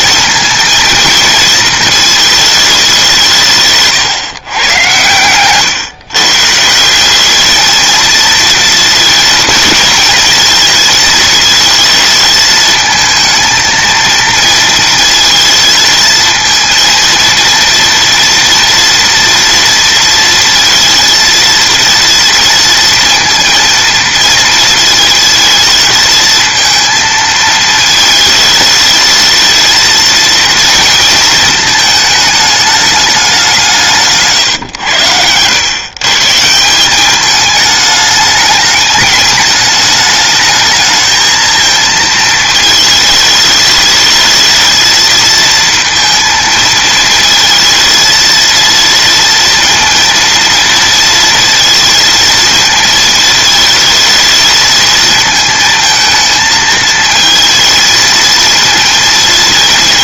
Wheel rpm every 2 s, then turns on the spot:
230, 220, 140, 140, 230, 230, 220, 230, 230, 230, 230, 230, 230, 220, 220, 230, 220, 150, 150, 210, 210, 220, 220, 230, 230, 230, 230, 220, 230, 220.
none